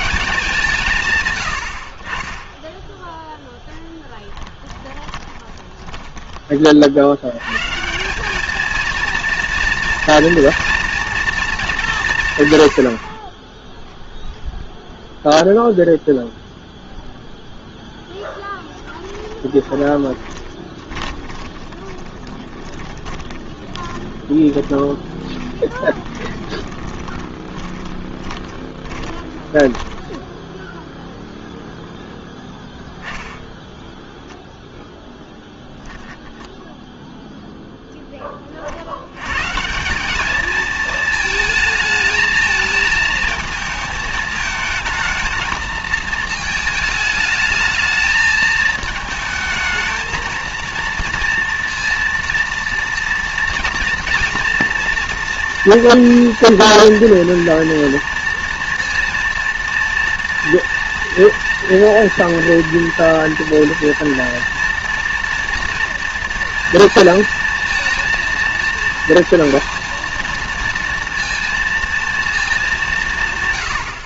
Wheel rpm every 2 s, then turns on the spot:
120, 0, 10, 90, 230, 230, 30, 0, 0, 20, 20, 20, 20, 10, 20, 0, 10, 10, 0, 70, 220, 220, 220, 220, 220, 230, 230, 230, 230, 230, 230, 230, 230, 230, 230, 230, 210.
4-6 18-30 32-36